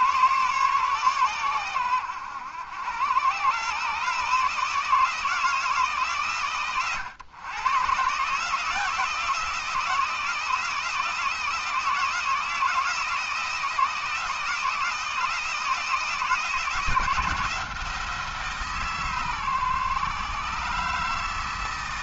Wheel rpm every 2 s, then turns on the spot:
140, 100, 160, 120, 170, 160, 160, 160, 160, 150, 150.
none